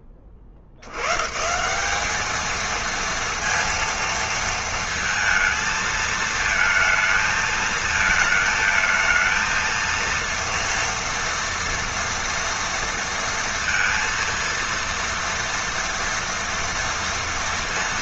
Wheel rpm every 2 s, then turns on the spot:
80, 230, 230, 220, 220, 230, 230, 230, 230.
none